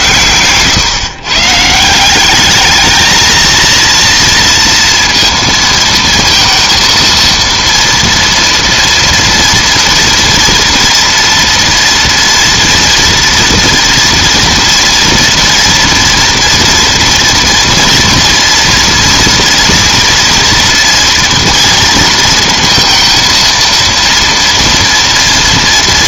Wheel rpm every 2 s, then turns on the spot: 140, 220, 230, 230, 230, 230, 230, 230, 230, 240, 230, 230, 230.
none